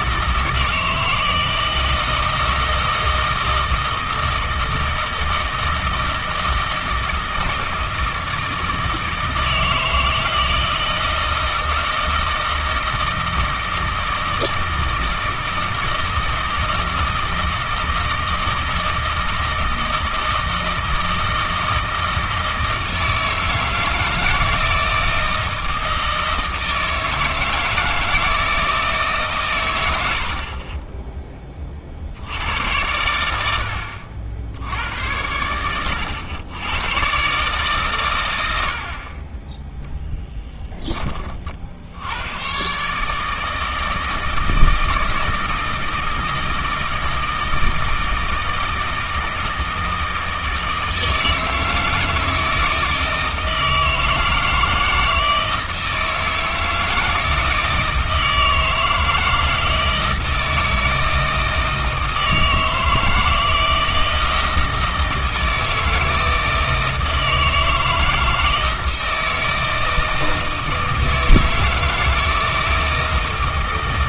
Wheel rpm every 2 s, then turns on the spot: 160, 160, 160, 160, 160, 160, 160, 160, 160, 160, 160, 160, 160, 160, 160, 30, 100, 90, 110, 60, 10, 130, 160, 160, 160, 160, 160, 160, 160, 160, 160, 160, 160, 160, 160, 160, 160.
none